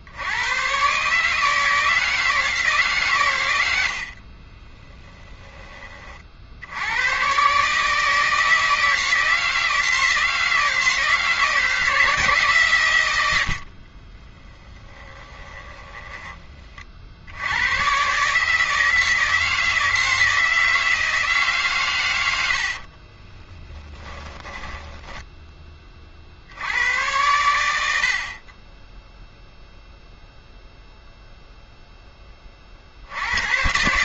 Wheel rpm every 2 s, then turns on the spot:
110, 150, 20, 80, 160, 160, 140, 10, 40, 160, 160, 70, 30, 80, 20, 0, 30.
4-6 14-16 22-26